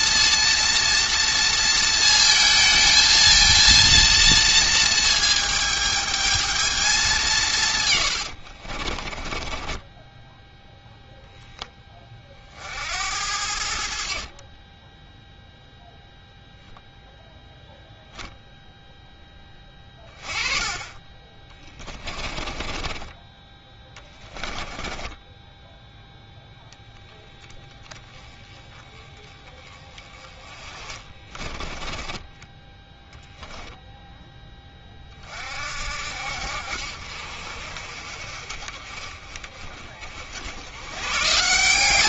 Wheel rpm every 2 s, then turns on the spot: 230, 220, 230, 210, 40, 0, 70, 20, 0, 0, 20, 20, 20, 10, 10, 30, 10, 30, 60, 40, 100.
8-10 22-26 30-32